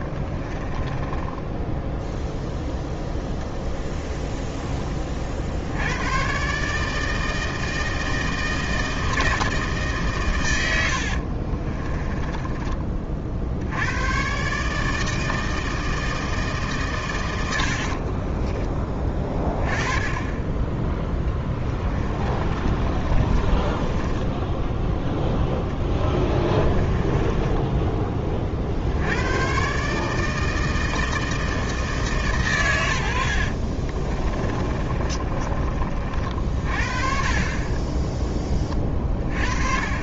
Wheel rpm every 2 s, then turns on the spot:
10, 0, 10, 150, 160, 80, 30, 150, 140, 20, 10, 30, 10, 20, 70, 160, 100, 30, 40, 20.
0-2 22-24 26-28 34-36